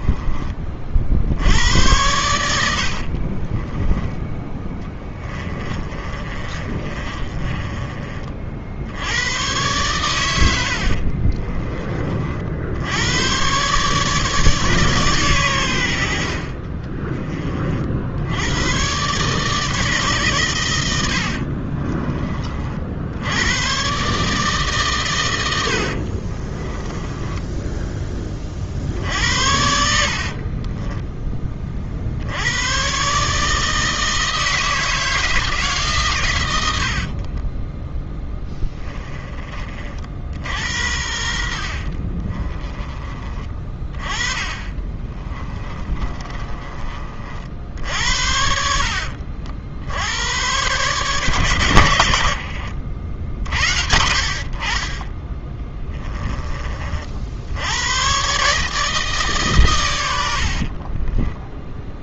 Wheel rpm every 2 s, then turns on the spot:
50, 70, 20, 30, 80, 50, 90, 140, 30, 120, 90, 70, 130, 10, 50, 10, 120, 160, 80, 20, 70, 20, 20, 40, 60, 130, 70, 30, 40, 150, 40.
2-8 10-12 16-18 26-28 30-32 36-40 42-46 48-50 60-62